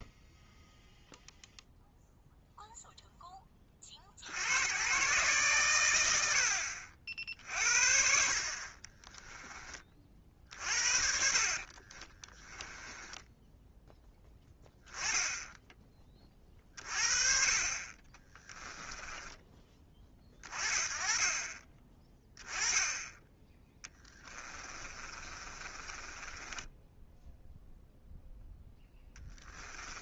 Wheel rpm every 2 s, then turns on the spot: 0, 40, 100, 60, 30, 40, 10, 10, 50, 30, 30, 10, 30, 0, 10.
10-12 24-26 28-30